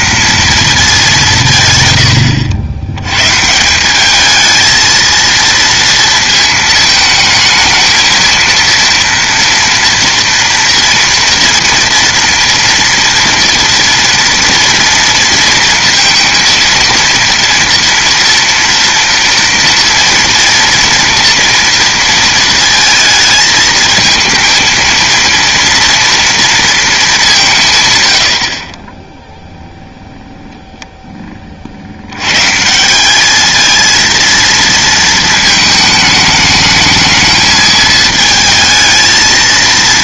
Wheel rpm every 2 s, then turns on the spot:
220, 90, 220, 220, 230, 230, 230, 230, 230, 230, 240, 220, 220, 230, 50, 0, 150, 230, 220, 220.
none